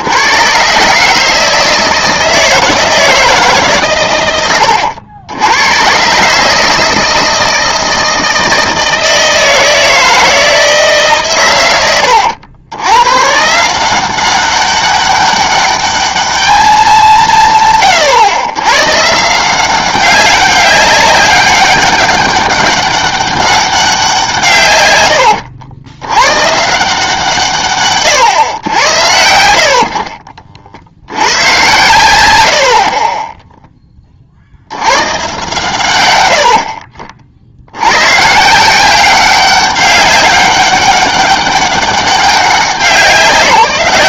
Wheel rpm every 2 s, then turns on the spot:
140, 160, 90, 160, 160, 160, 90, 190, 210, 120, 200, 200, 130, 150, 100, 50, 70, 80, 60, 170, 200, 190.
none